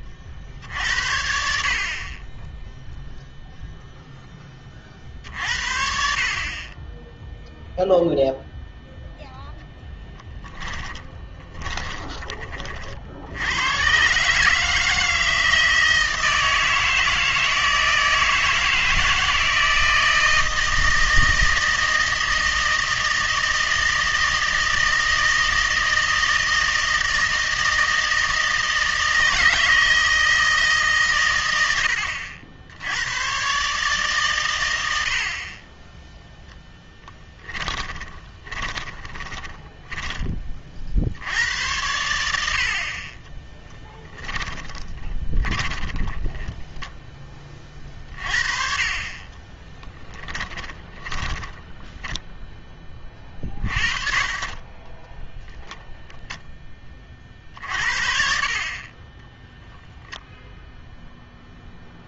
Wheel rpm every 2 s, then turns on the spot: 70, 10, 40, 20, 0, 20, 40, 160, 160, 160, 160, 160, 160, 160, 160, 150, 80, 90, 0, 20, 40, 60, 20, 10, 40, 10, 20, 30, 10, 40, 0.
10-12 38-40 44-48 50-52